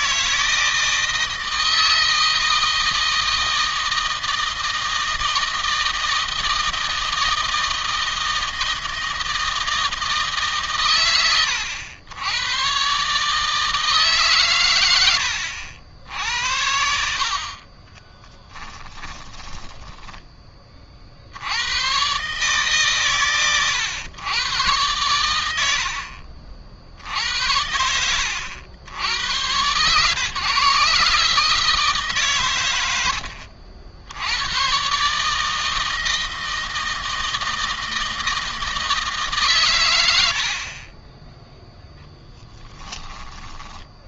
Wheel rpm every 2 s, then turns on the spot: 160, 160, 160, 160, 160, 140, 120, 130, 70, 10, 30, 140, 110, 50, 90, 140, 110, 120, 160, 160, 60, 10.
18-20 40-44